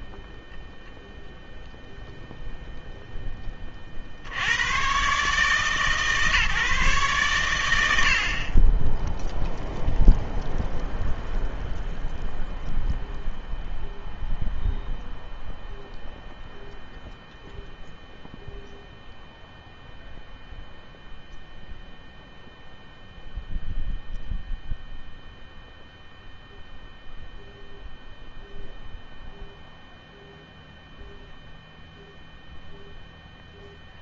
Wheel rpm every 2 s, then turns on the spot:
10, 0, 80, 150, 40, 0, 0, 0, 0, 0, 0, 0, 0, 0, 0, 0, 0.
0-2